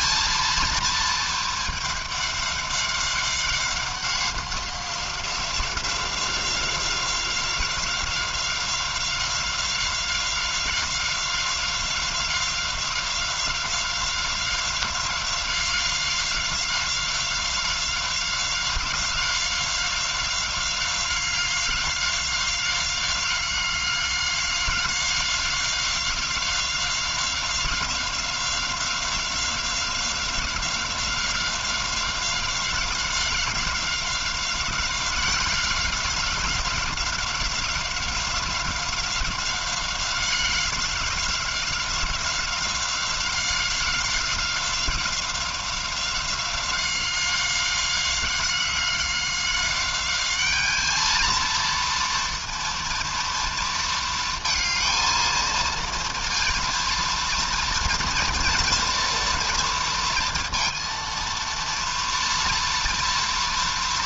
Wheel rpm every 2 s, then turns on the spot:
230, 200, 180, 180, 180, 180, 190, 190, 190, 190, 190, 190, 190, 190, 190, 190, 190, 190, 180, 190, 190, 190, 190, 190, 190, 210, 230, 220, 230, 230, 230, 230.
none